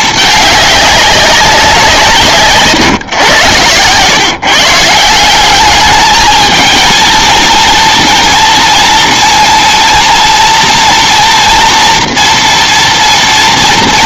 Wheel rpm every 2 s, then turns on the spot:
200, 140, 160, 230, 230, 230, 230.
none